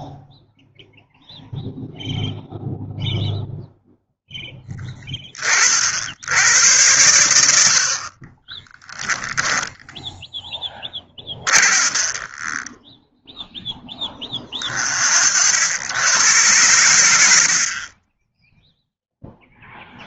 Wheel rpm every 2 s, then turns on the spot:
0, 0, 30, 100, 10, 30, 0, 70, 80, 0.
10-12